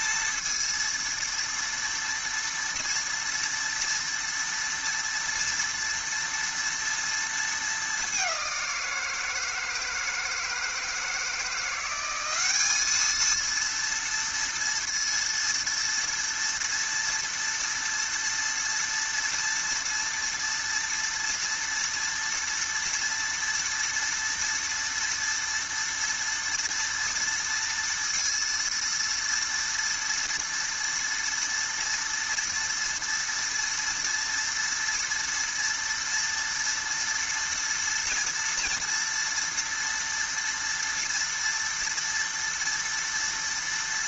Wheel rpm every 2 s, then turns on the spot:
230, 230, 230, 230, 170, 160, 210, 230, 240, 230, 230, 230, 230, 230, 230, 230, 230, 230, 230, 230, 230, 230.
none